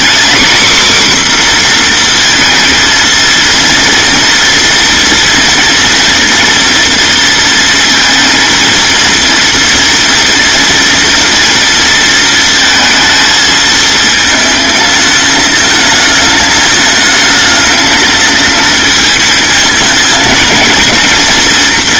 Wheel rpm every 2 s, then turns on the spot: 260, 230, 230, 230, 230, 230, 230, 220, 220, 230, 230.
none